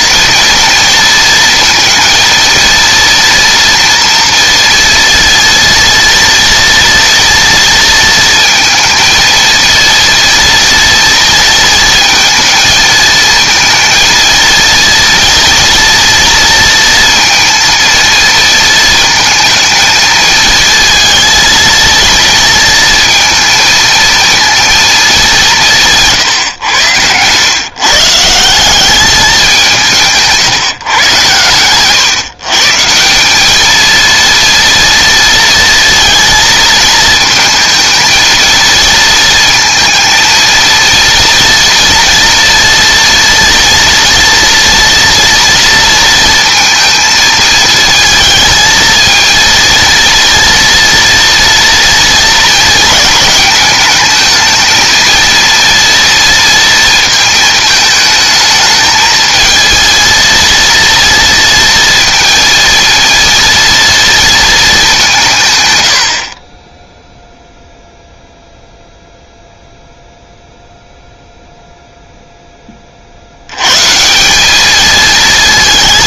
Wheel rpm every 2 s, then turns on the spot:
230, 230, 230, 230, 230, 230, 220, 230, 230, 230, 220, 230, 230, 110, 180, 150, 160, 230, 230, 230, 230, 230, 230, 220, 220, 230, 230, 220, 230, 220, 230, 230, 210, 20, 0, 0, 20, 210.
none